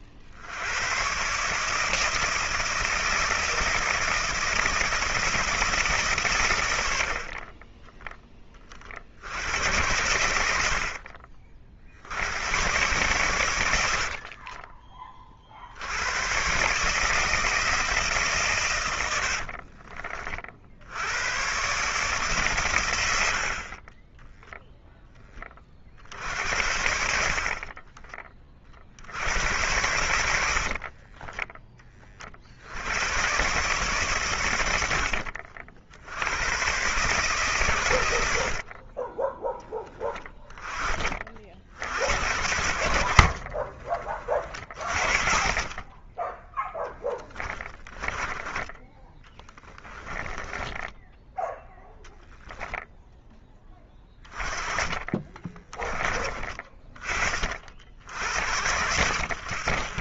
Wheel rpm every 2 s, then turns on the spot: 90, 160, 160, 90, 30, 70, 110, 30, 140, 130, 60, 120, 0, 70, 40, 50, 80, 100, 110, 50, 20, 70, 30, 0, 10, 10, 0, 20, 30, 70.
10-12 14-16 30-32 50-52 54-56